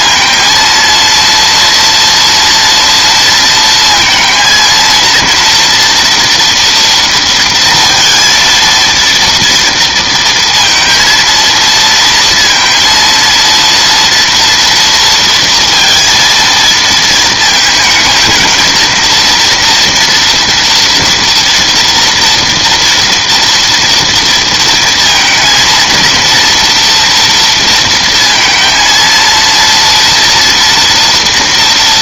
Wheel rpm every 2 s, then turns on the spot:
230, 240, 230, 230, 230, 230, 230, 230, 230, 230, 240, 230, 230, 230, 230, 240.
none